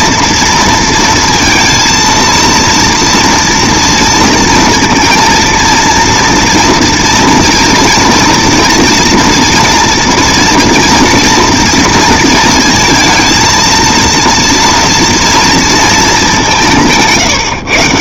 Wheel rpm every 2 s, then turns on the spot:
230, 230, 230, 230, 230, 240, 230, 230, 170.
none